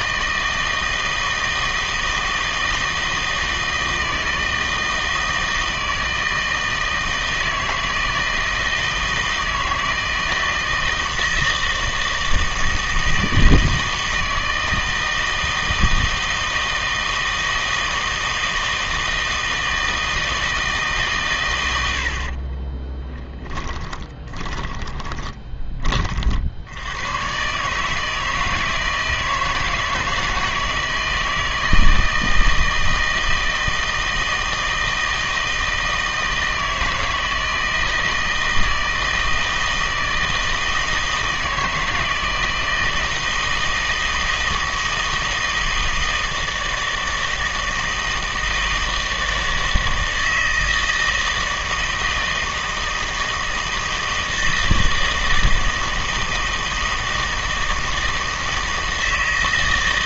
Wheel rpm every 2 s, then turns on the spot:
160, 160, 160, 160, 160, 160, 160, 160, 160, 160, 150, 20, 20, 90, 160, 160, 160, 160, 160, 160, 160, 160, 160, 160, 160, 160, 160, 160, 160, 160.
22-26